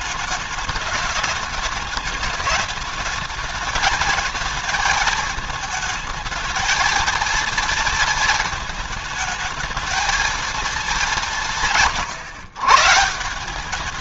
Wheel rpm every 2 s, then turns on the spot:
210, 220, 220, 220, 220, 210, 140.
none